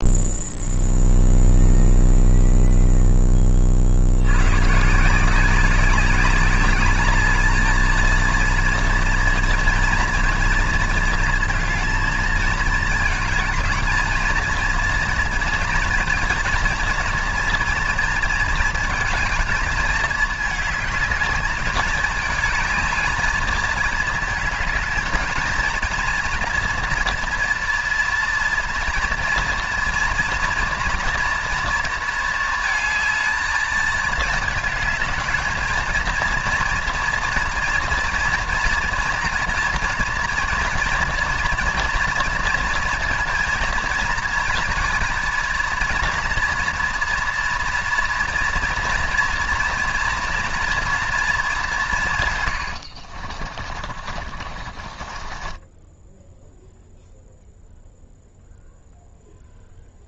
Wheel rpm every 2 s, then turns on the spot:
0, 0, 160, 210, 230, 220, 220, 230, 230, 230, 220, 220, 220, 240, 230, 230, 220, 210, 230, 230, 230, 230, 230, 230, 230, 230, 90, 30, 0, 0.
52-56